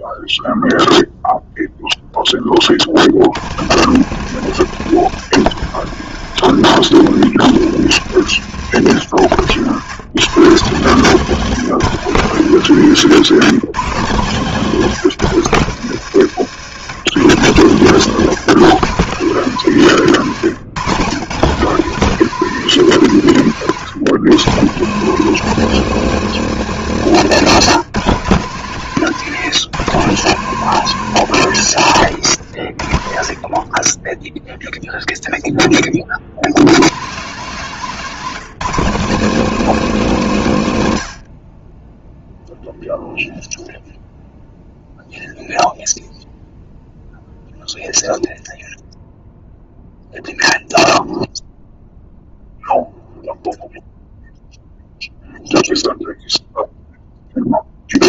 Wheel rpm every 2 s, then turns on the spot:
0, 90, 130, 130, 120, 200, 180, 170, 170, 190, 190, 160, 220, 180, 160, 120, 50, 10, 190, 220, 50, 0, 0, 0, 0, 0, 0, 0, 0.
30-34